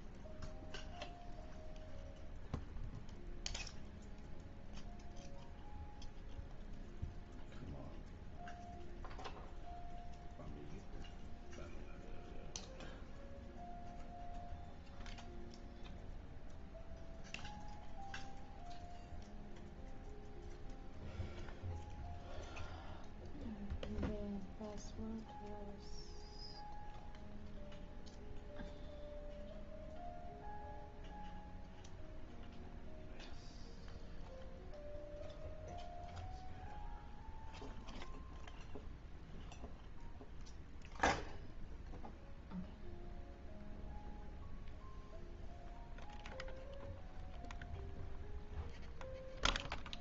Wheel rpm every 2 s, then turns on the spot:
0, 0, 0, 0, 0, 0, 0, 0, 0, 0, 0, 0, 0, 0, 0, 0, 0, 0, 0, 0, 0, 0, 0, 0, 0.
none